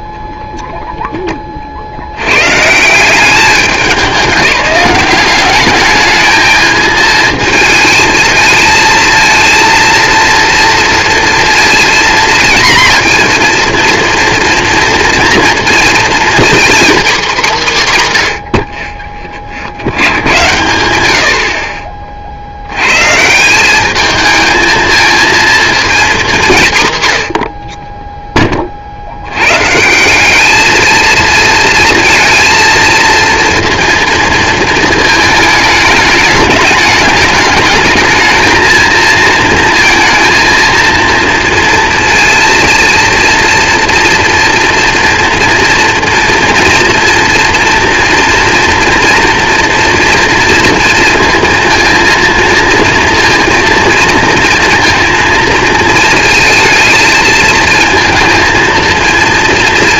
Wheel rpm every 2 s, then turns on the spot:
10, 140, 190, 220, 220, 230, 230, 230, 250, 60, 80, 90, 220, 160, 30, 220, 230, 220, 210, 220, 230, 230, 230, 230, 230, 230, 230, 230, 220, 230.
18-20